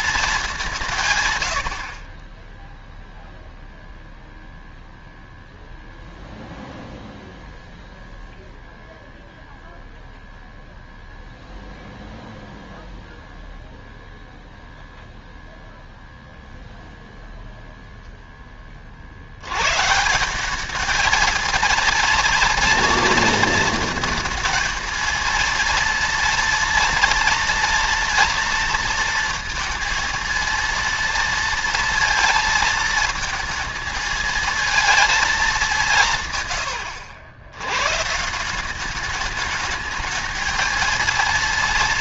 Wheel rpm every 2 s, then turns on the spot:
180, 0, 0, 0, 0, 0, 0, 0, 0, 40, 210, 230, 220, 230, 230, 230, 220, 220, 100, 200, 220.
36-38